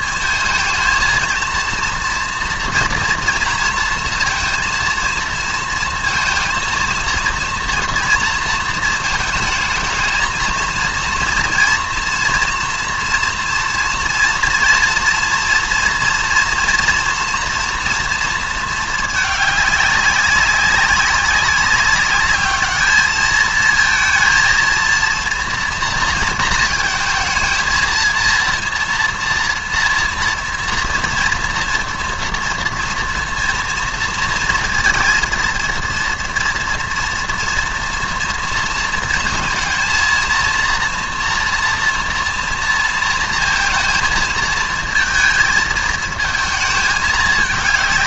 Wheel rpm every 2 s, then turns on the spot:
220, 230, 230, 230, 230, 230, 230, 230, 230, 230, 200, 210, 230, 220, 230, 230, 230, 230, 230, 230, 230, 230, 220, 220.
none